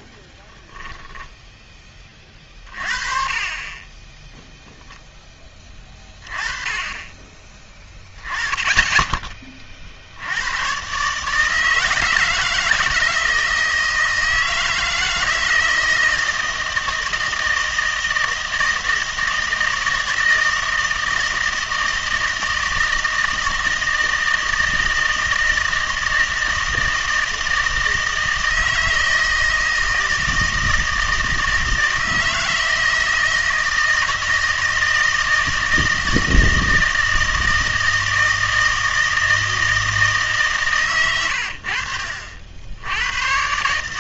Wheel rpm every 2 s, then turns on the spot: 10, 40, 0, 20, 10, 110, 160, 160, 160, 160, 160, 160, 160, 160, 160, 160, 160, 160, 160, 160, 130, 70.
0-2